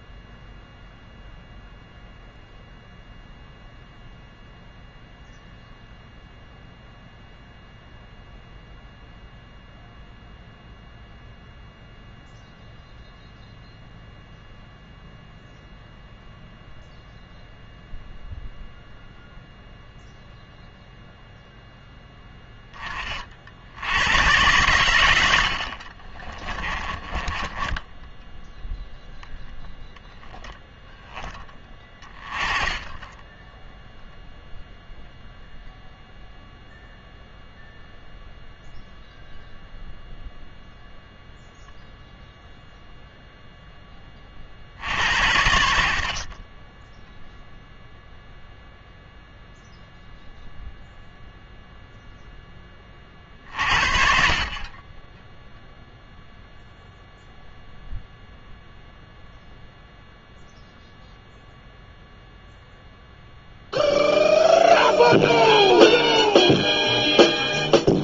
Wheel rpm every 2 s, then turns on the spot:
0, 0, 0, 0, 0, 0, 0, 0, 0, 0, 0, 20, 120, 20, 0, 10, 20, 0, 0, 0, 0, 0, 60, 10, 0, 0, 40, 20, 0, 0, 0, 0, 0, 0.
26-28